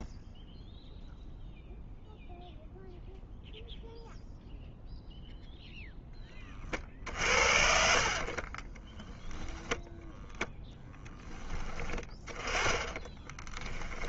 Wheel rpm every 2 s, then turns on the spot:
0, 0, 0, 50, 20, 10, 20.
8-10 12-14